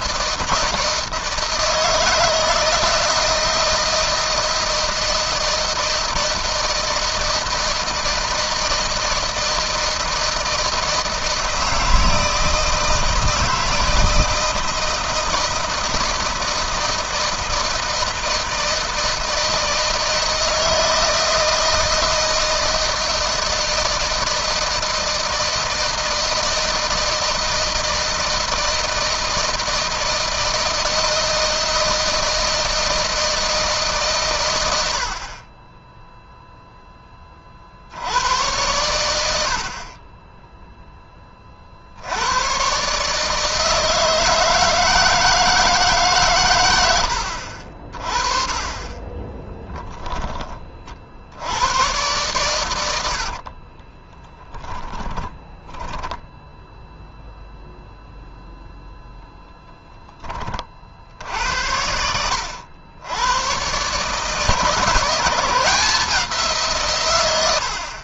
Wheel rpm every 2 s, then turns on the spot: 160, 160, 160, 160, 160, 160, 160, 160, 160, 160, 160, 160, 160, 160, 160, 160, 160, 70, 20, 100, 20, 150, 160, 90, 20, 50, 80, 10, 0, 0, 50, 100, 170, 120.
48-50 52-56